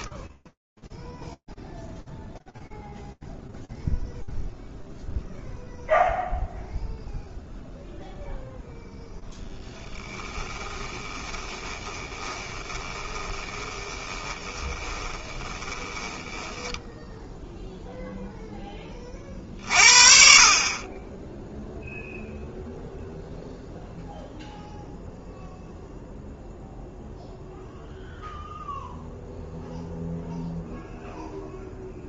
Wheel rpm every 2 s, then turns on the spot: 10, 0, 0, 0, 0, 20, 20, 20, 10, 30, 20, 0, 0, 0, 0, 0.
0-2 10-18